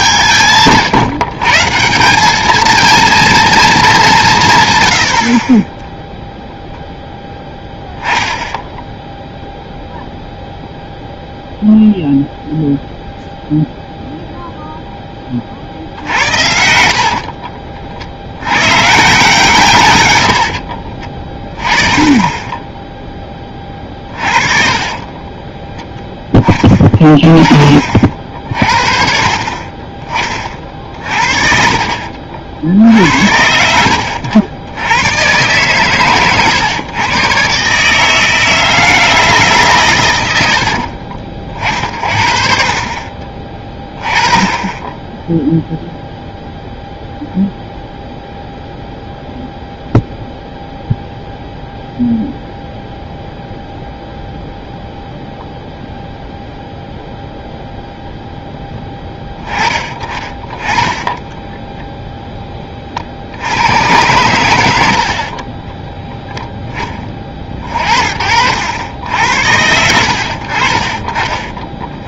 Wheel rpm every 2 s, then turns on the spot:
120, 230, 140, 0, 0, 0, 0, 0, 70, 120, 40, 10, 40, 20, 50, 40, 60, 100, 120, 160, 60, 40, 20, 0, 0, 0, 0, 0, 0, 0, 20, 10, 70, 10, 80, 50.
20-22 24-26 40-42 60-62